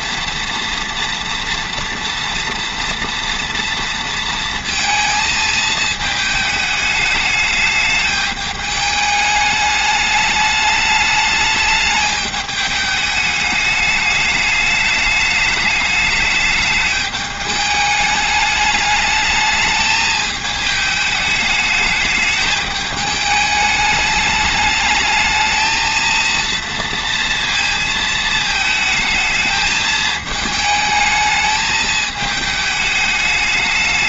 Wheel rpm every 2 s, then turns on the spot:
230, 230, 230, 220, 210, 210, 210, 210, 210, 210, 210, 210, 210, 230, 220, 220, 210.
none